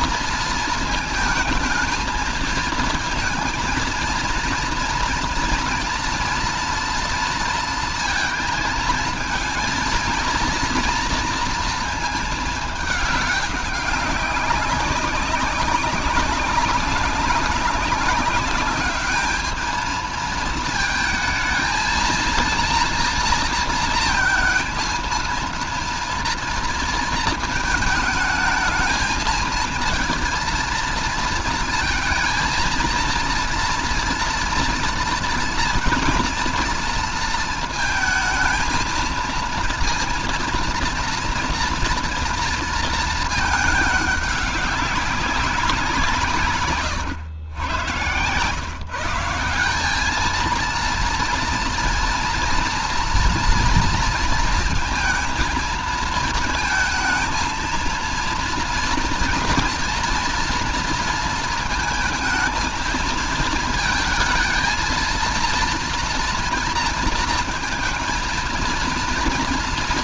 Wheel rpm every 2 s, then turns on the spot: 220, 220, 230, 230, 220, 230, 210, 200, 200, 200, 220, 230, 220, 230, 220, 230, 230, 230, 230, 220, 230, 230, 200, 140, 130, 220, 230, 230, 220, 230, 230, 220, 230, 240, 220.
none